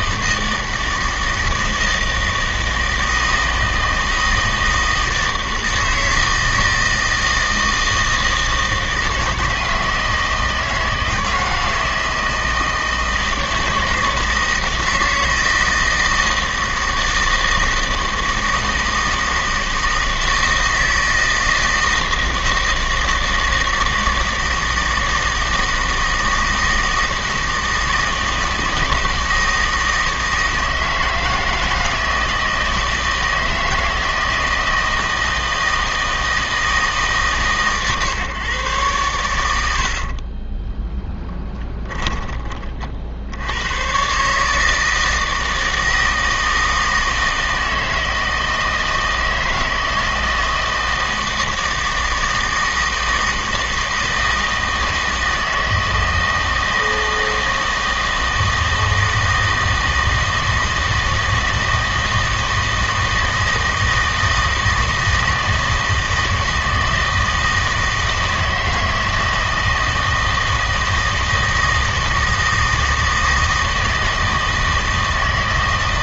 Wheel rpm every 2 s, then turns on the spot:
160, 160, 160, 160, 160, 160, 160, 160, 160, 160, 160, 160, 160, 160, 160, 160, 160, 160, 160, 130, 20, 50, 160, 160, 160, 160, 160, 160, 160, 160, 160, 160, 160, 160, 160, 160, 160, 160.
40-42